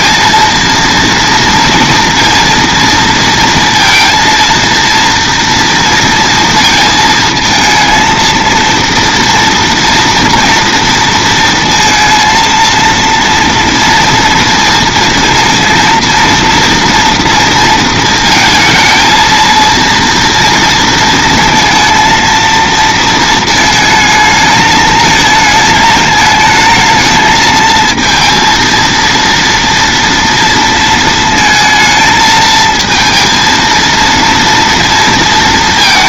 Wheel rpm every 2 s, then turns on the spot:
230, 230, 230, 230, 230, 230, 230, 230, 230, 230, 230, 230, 220, 220, 230, 230, 230, 230.
none